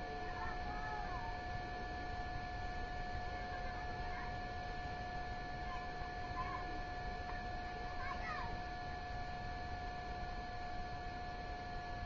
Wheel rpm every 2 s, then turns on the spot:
0, 0, 0, 0, 0, 0.
none